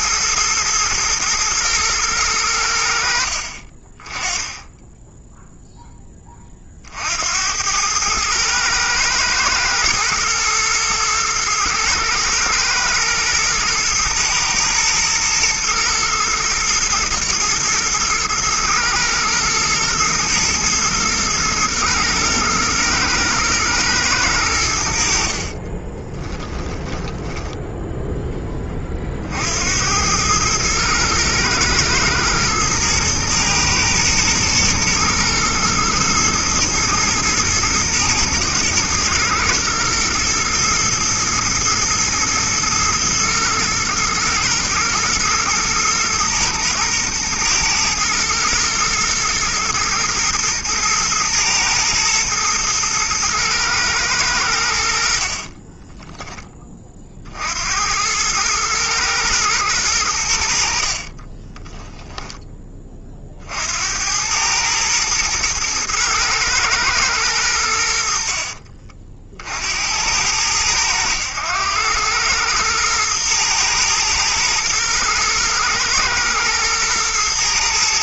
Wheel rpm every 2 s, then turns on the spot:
110, 80, 10, 60, 110, 110, 110, 110, 110, 110, 110, 110, 70, 10, 30, 110, 110, 110, 120, 110, 110, 110, 110, 110, 110, 120, 110, 70, 30, 110, 40, 30, 110, 110, 50, 100, 110, 120, 110.
26-28 60-62